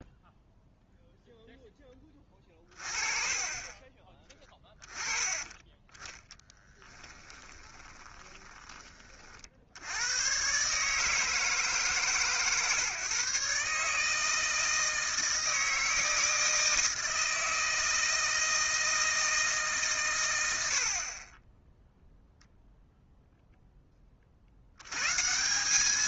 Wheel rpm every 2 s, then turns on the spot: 0, 30, 20, 10, 30, 140, 130, 160, 160, 160, 90, 0, 70.
6-8